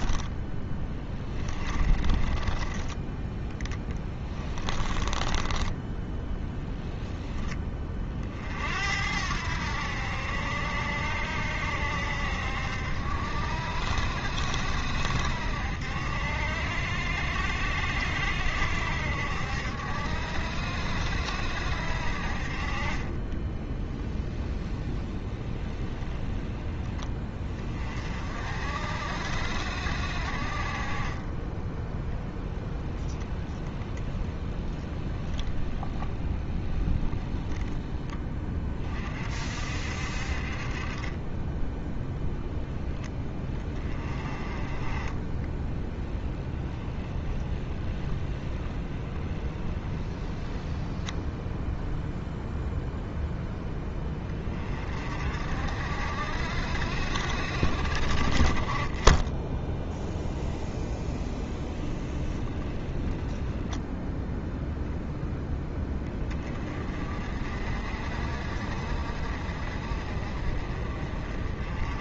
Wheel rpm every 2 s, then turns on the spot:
10, 20, 20, 10, 70, 70, 70, 70, 70, 70, 70, 40, 10, 20, 60, 40, 0, 10, 20, 30, 40, 10, 20, 10, 10, 10, 0, 30, 60, 30, 10, 10, 0, 30, 50, 40.
0-2 4-6 24-26 34-38 46-52 60-64